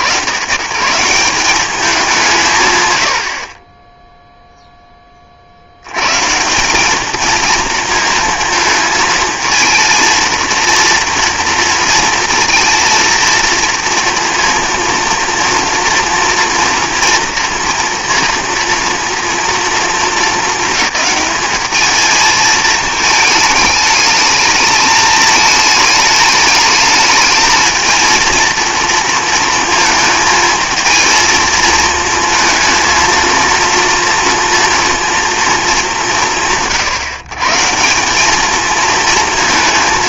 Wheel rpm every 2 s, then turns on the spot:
120, 100, 10, 180, 220, 230, 230, 230, 230, 230, 220, 220, 220, 210, 230, 220, 230, 230, 150, 220.
none